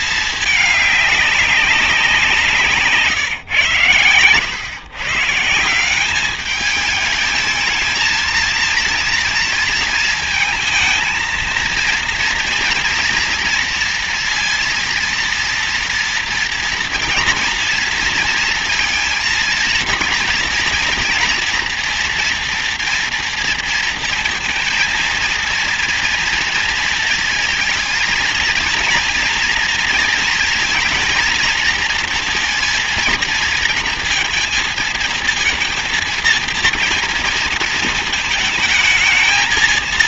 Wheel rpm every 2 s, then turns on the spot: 210, 160, 120, 210, 230, 220, 230, 230, 230, 230, 240, 230, 230, 230, 230, 230, 220, 230, 230, 220.
none